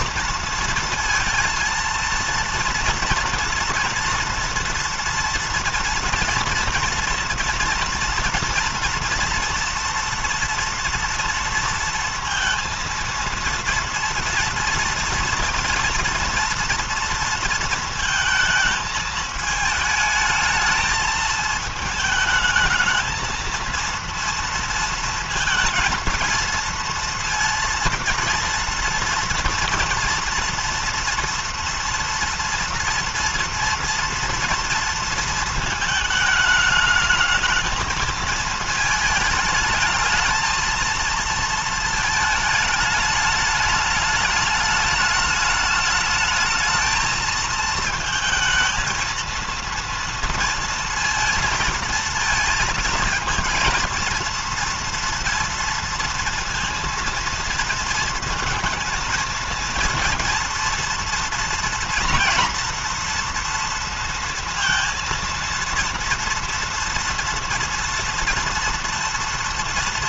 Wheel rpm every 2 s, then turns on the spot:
230, 230, 230, 230, 230, 230, 230, 230, 230, 220, 220, 220, 230, 230, 230, 230, 230, 230, 220, 220, 220, 210, 210, 220, 220, 230, 230, 230, 230, 220, 230, 230, 230, 230, 240.
none